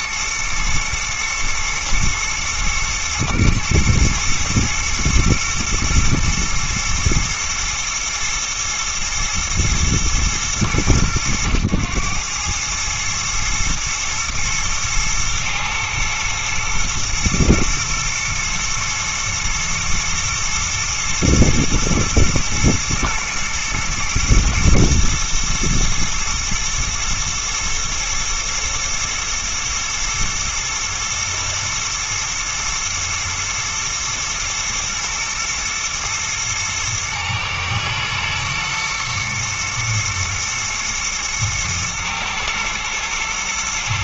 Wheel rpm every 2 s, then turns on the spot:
110, 110, 120, 120, 120, 100, 110, 110, 110, 110, 120, 120, 120, 110, 110, 110, 120, 110, 110, 110, 120, 120.
none